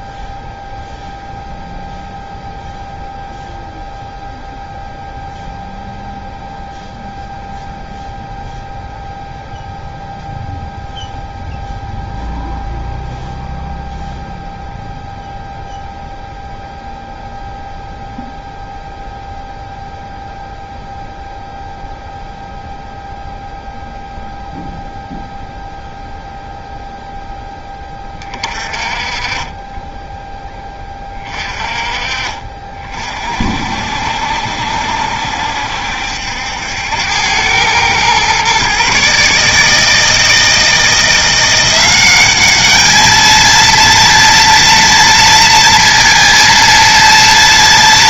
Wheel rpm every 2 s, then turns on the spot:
0, 0, 0, 0, 0, 0, 0, 0, 0, 0, 0, 0, 0, 0, 30, 20, 40, 60, 90, 140, 160, 210, 230, 230.
none